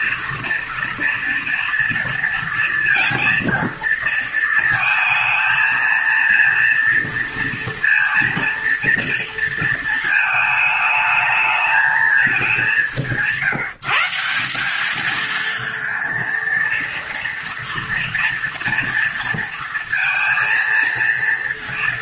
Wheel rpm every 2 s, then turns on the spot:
230, 230, 230, 230, 230, 220, 170, 220, 230, 230, 230.
none